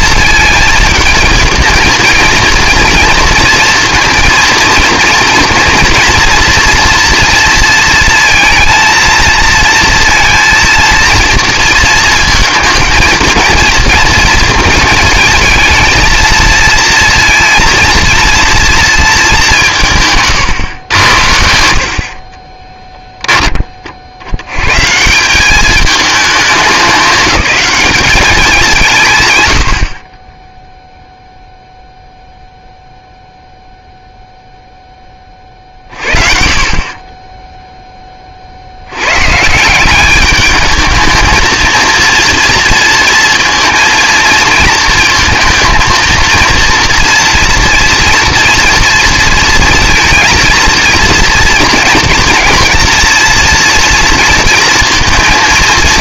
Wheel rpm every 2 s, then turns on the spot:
220, 240, 230, 230, 230, 230, 230, 220, 230, 230, 110, 10, 120, 190, 170, 0, 0, 0, 40, 80, 210, 230, 230, 230, 230, 230, 230, 230.
22-24